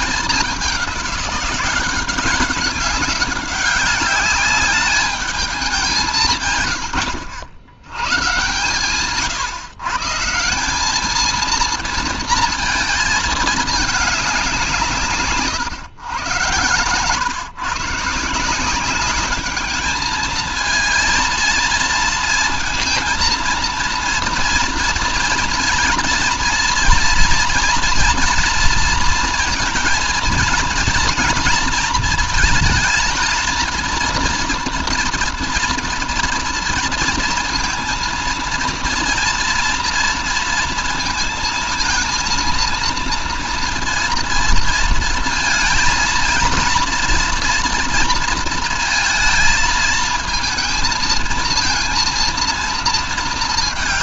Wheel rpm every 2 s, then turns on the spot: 200, 200, 210, 110, 130, 200, 220, 170, 120, 190, 230, 230, 240, 230, 230, 220, 220, 240, 230, 230, 230, 230, 230, 240, 230, 230, 230.
none